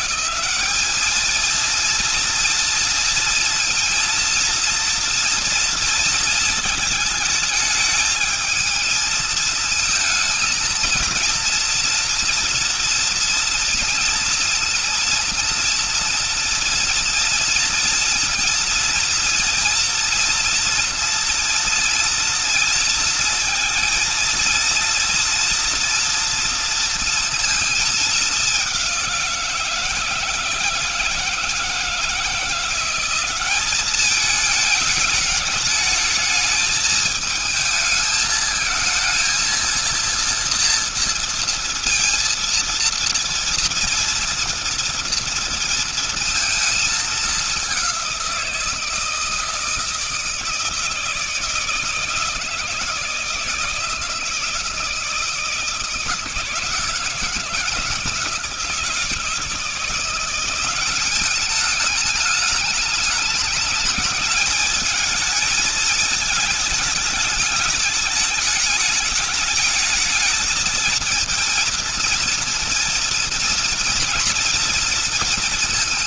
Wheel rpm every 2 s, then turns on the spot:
190, 230, 230, 230, 220, 230, 230, 230, 240, 230, 240, 230, 230, 230, 210, 160, 170, 210, 220, 220, 230, 230, 230, 220, 180, 160, 160, 160, 160, 160, 170, 210, 220, 220, 210, 220, 230, 230.
none